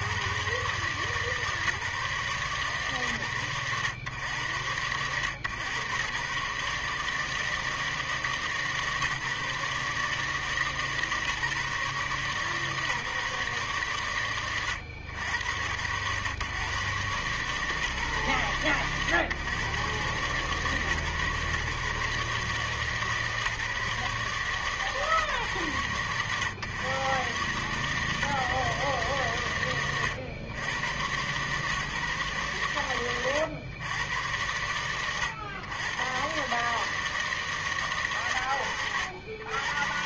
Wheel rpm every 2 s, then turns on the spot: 70, 150, 100, 110, 150, 140, 130, 100, 110, 130, 130, 150, 140, 100, 140, 90, 140, 90, 110, 110.
none